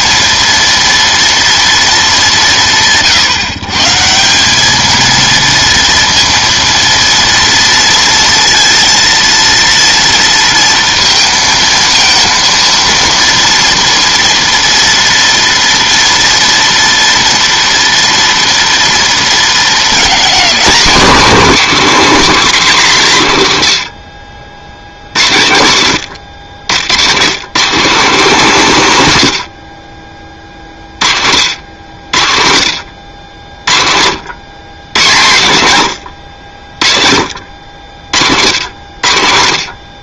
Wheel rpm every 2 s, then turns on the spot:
230, 170, 200, 230, 230, 230, 230, 230, 230, 240, 220, 210, 70, 90, 200, 30, 70, 100, 60, 80.
none